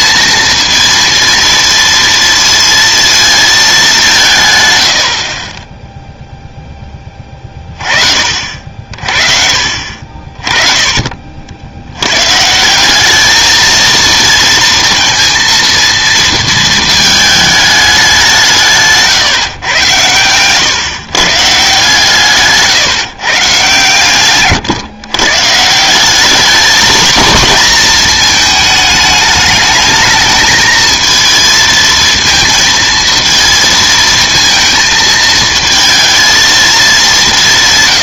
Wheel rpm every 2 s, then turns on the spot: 230, 230, 100, 10, 50, 30, 170, 230, 220, 150, 120, 150, 140, 220, 220, 220, 230, 220, 220.
none